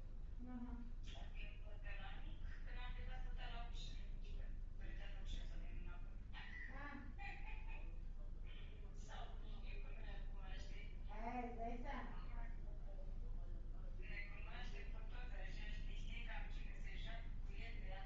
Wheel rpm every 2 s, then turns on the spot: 0, 0, 0, 0, 0, 0, 0, 0, 0.
none